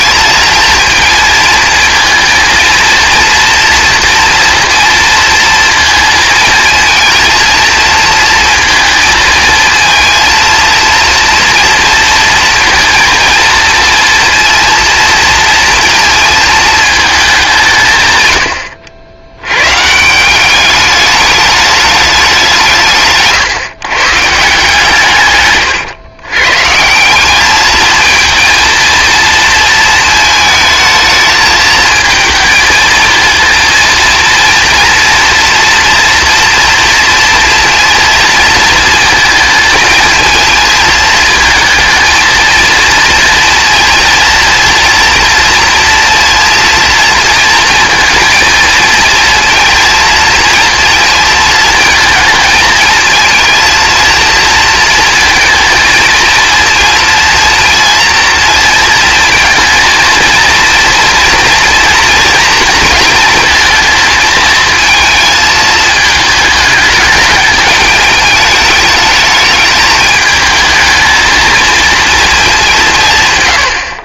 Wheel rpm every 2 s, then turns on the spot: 230, 230, 230, 230, 220, 230, 230, 230, 220, 80, 200, 150, 150, 160, 230, 220, 220, 230, 230, 230, 220, 230, 230, 230, 230, 230, 220, 230, 230, 230, 230, 230, 220, 210, 210, 220, 170.
none